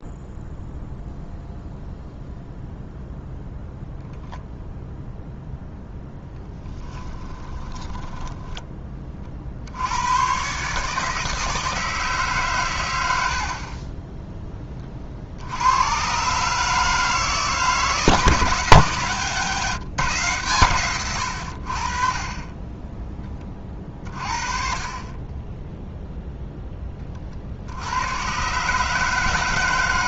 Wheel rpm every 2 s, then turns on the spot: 0, 0, 0, 10, 20, 130, 120, 20, 150, 150, 130, 20, 40, 10, 140.
6-8